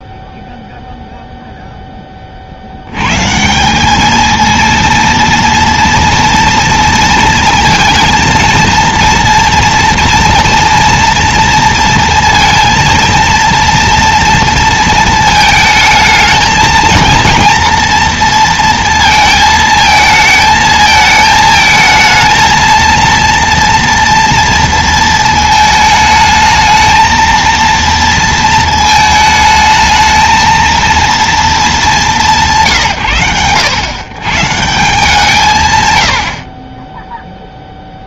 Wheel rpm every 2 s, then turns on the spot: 0, 90, 230, 230, 230, 230, 230, 220, 220, 230, 220, 230, 230, 220, 230, 220, 150, 160, 30.
none